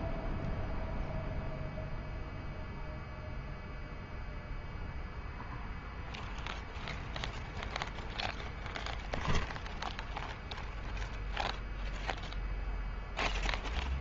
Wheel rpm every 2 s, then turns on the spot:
0, 0, 0, 0, 0, 0, 0.
none